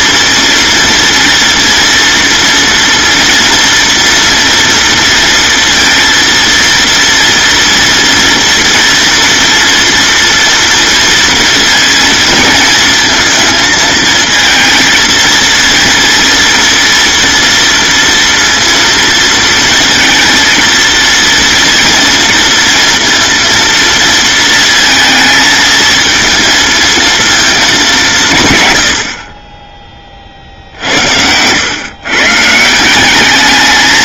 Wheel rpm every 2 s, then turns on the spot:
230, 230, 230, 230, 230, 230, 230, 230, 230, 230, 230, 230, 230, 230, 80, 80, 180.
30-32